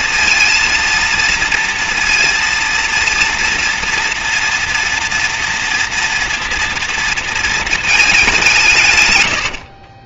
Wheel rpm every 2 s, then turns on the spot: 230, 230, 240, 240, 170.
none